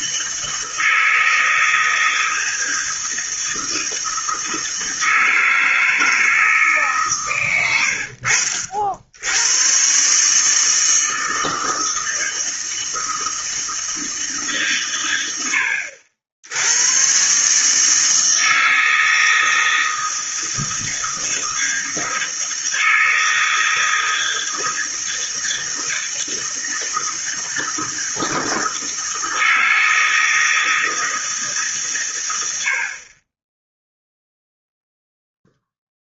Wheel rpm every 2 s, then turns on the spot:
160, 160, 160, 150, 60, 150, 160, 140, 90, 160, 160, 160, 160, 160, 160, 160, 70, 0.
none